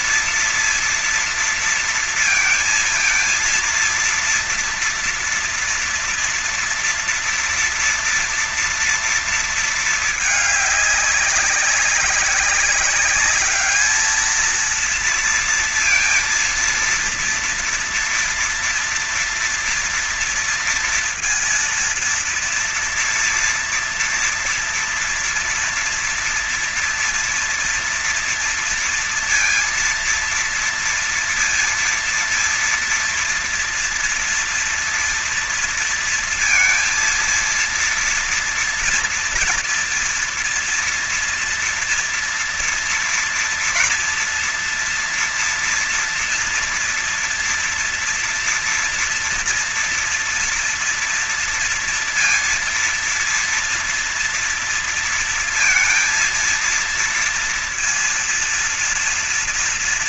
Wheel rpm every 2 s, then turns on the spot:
230, 220, 230, 230, 230, 210, 200, 220, 230, 230, 230, 240, 230, 230, 230, 230, 230, 230, 230, 230, 230, 230, 230, 230, 230, 230, 230, 230, 230, 230.
none